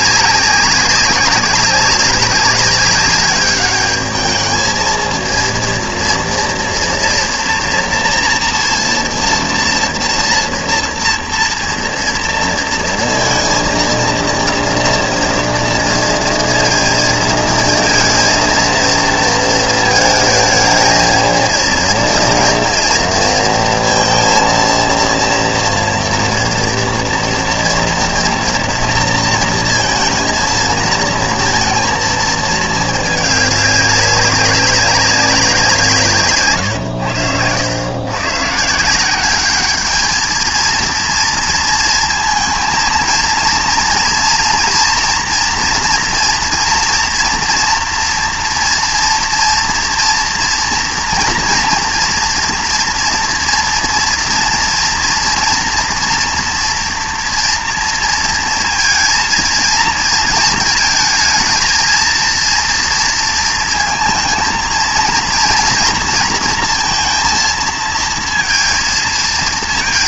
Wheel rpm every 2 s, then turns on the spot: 200, 200, 220, 230, 230, 230, 230, 230, 230, 230, 220, 230, 230, 230, 230, 230, 220, 200, 130, 140, 220, 230, 230, 230, 230, 230, 240, 240, 230, 230, 230, 230, 230, 230, 230.
none